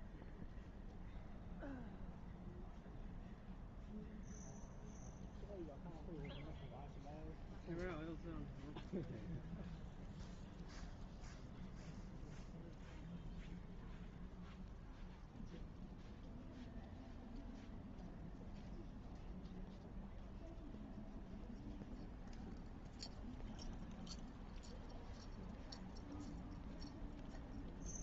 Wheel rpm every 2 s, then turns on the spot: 0, 0, 0, 0, 0, 0, 0, 0, 0, 0, 0, 0, 0, 0.
none